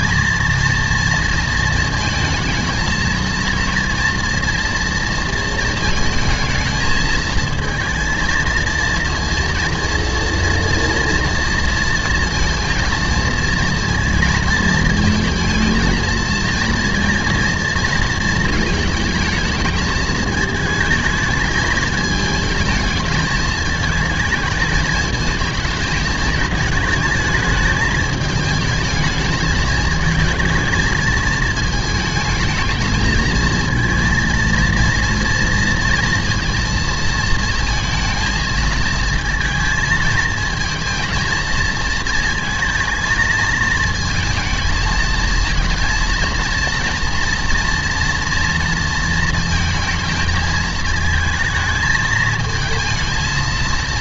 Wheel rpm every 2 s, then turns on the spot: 230, 220, 230, 220, 230, 230, 230, 230, 230, 220, 220, 220, 220, 220, 220, 220, 220, 230, 230, 230, 230, 230, 220, 230, 230, 220, 220.
none